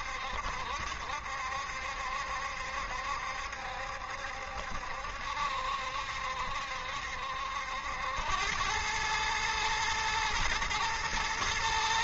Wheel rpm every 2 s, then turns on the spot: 70, 70, 70, 70, 110, 120.
none